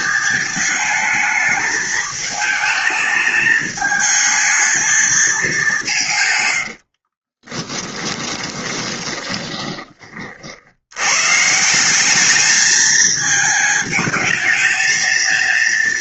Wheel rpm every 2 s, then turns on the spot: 230, 210, 220, 110, 20, 60, 210, 220.
6-10